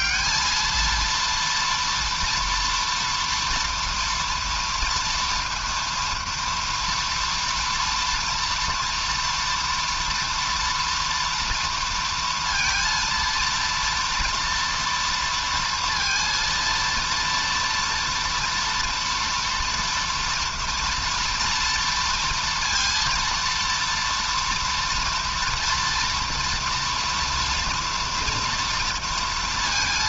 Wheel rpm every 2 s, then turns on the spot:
220, 230, 230, 230, 230, 230, 230, 240, 230, 230, 230, 230, 230, 240, 230.
none